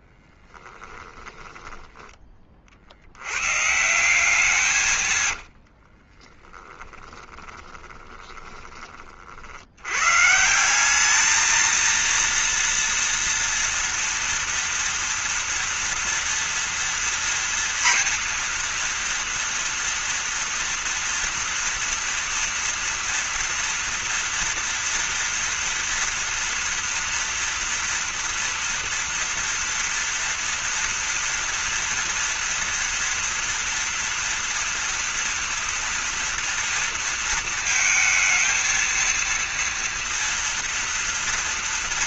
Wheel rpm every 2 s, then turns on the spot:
20, 40, 170, 30, 20, 160, 230, 230, 230, 230, 230, 230, 230, 230, 230, 230, 240, 240, 230, 230, 230.
0-2 6-8